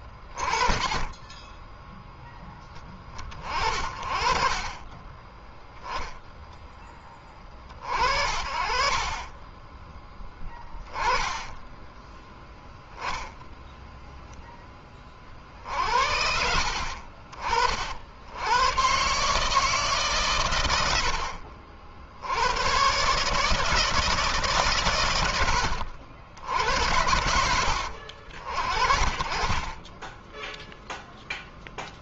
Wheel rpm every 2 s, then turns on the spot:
30, 20, 20, 10, 40, 20, 0, 30, 50, 120, 90, 130, 130, 80, 40, 0.
0-2 4-6 20-22